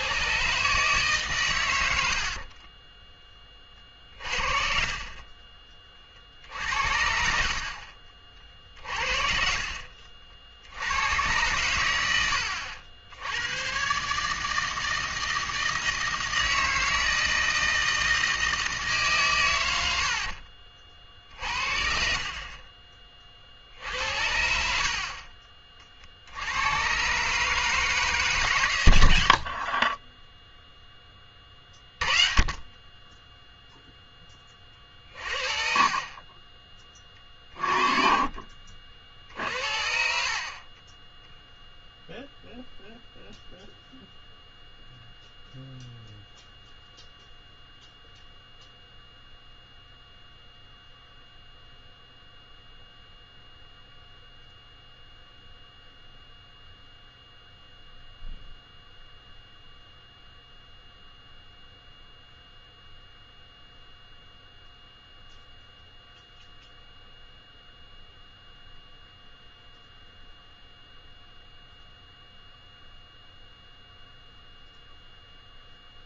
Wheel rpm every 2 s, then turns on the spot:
140, 30, 40, 70, 50, 80, 80, 160, 160, 150, 50, 30, 60, 110, 120, 10, 30, 40, 30, 50, 30, 0, 0, 0, 0, 0, 0, 0, 0, 0, 0, 0, 0, 0, 0, 0, 0, 0.
2-4 24-26